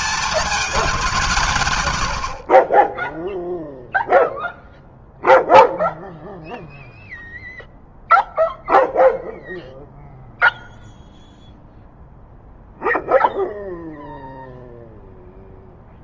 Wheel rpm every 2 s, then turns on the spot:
220, 40, 0, 0, 0, 0, 0, 0.
none